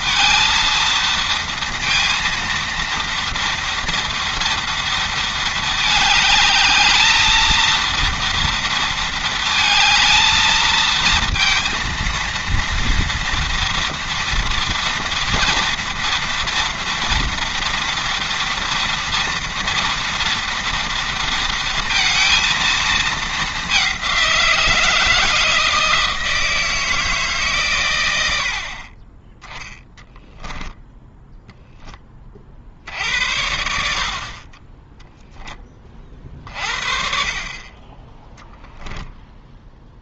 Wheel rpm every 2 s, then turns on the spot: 230, 230, 230, 220, 230, 230, 230, 230, 240, 230, 230, 220, 170, 160, 30, 10, 50, 20, 50, 0.
none